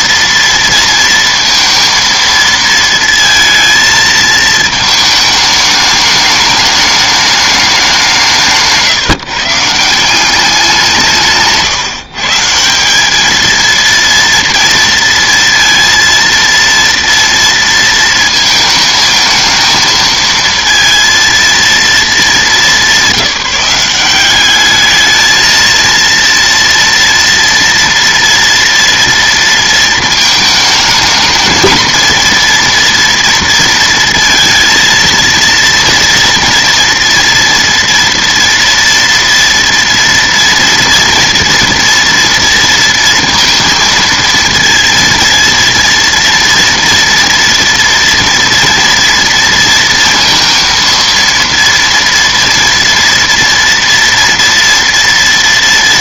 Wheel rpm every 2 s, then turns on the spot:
230, 230, 220, 210, 150, 180, 180, 230, 230, 220, 230, 210, 210, 230, 230, 220, 230, 230, 230, 230, 230, 230, 230, 230, 230, 230, 230, 230.
8-10